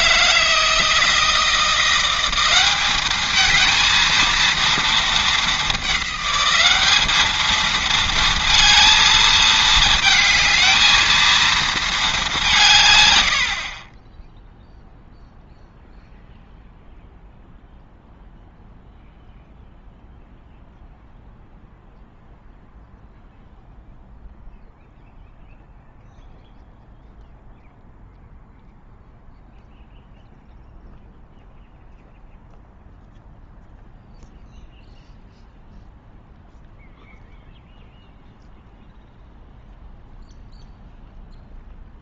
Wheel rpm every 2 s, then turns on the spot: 160, 200, 220, 200, 230, 220, 140, 0, 0, 0, 0, 0, 0, 0, 0, 0, 0, 0, 0, 0, 0.
none